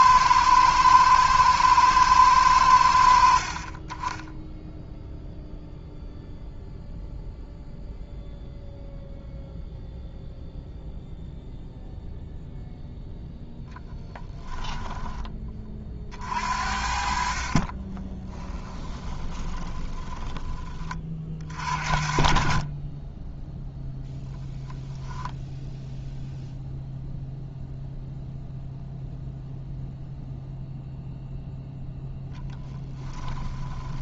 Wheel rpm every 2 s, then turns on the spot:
110, 90, 0, 0, 0, 0, 0, 10, 60, 20, 20, 20, 0, 0, 0, 0, 10.
16-20 32-34